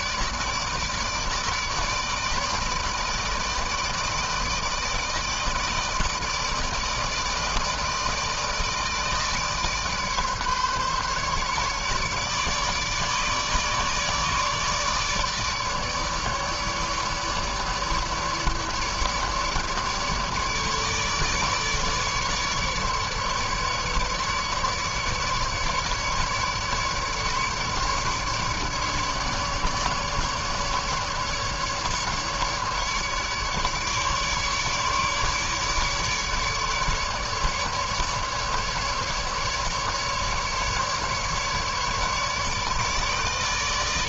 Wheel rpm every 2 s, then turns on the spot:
150, 160, 160, 150, 160, 150, 150, 150, 150, 150, 150, 150, 150, 150, 150, 150, 150, 150, 150, 150, 150, 150.
none